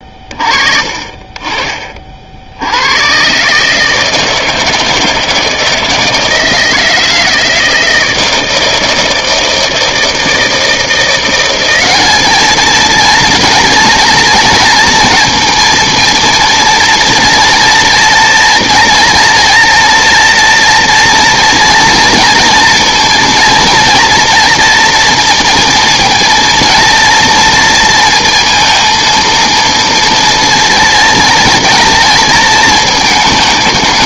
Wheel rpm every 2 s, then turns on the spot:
40, 60, 160, 160, 160, 160, 210, 230, 230, 230, 230, 240, 230, 230, 230, 230, 230.
none